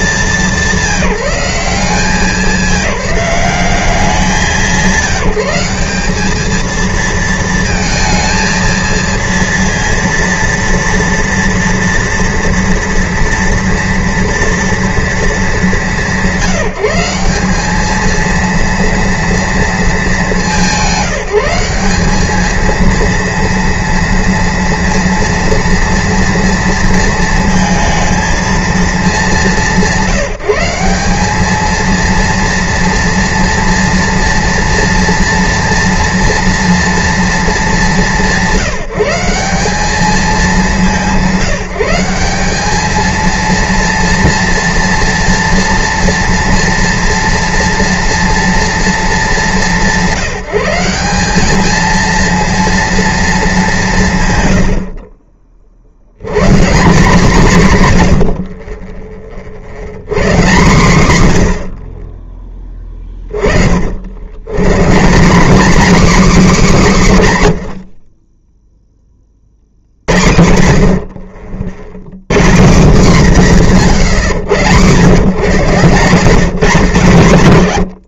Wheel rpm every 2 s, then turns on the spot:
180, 190, 190, 220, 230, 230, 230, 230, 190, 230, 190, 220, 230, 230, 220, 180, 230, 230, 230, 180, 190, 200, 230, 230, 230, 180, 230, 110, 150, 50, 140, 20, 130, 250, 10, 70, 160, 110, 160.
68-70